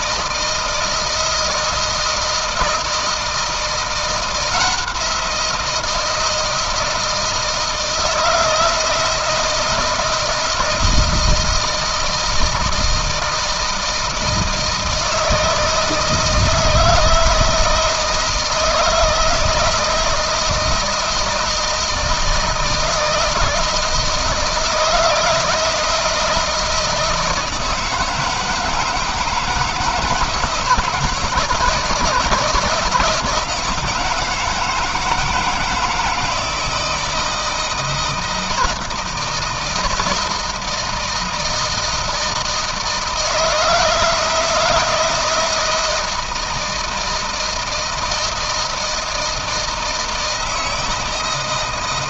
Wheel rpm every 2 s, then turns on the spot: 160, 160, 170, 160, 160, 160, 170, 160, 160, 160, 160, 160, 170, 160, 160, 160, 160, 160, 160, 160, 160, 160, 160, 160, 160, 160.
none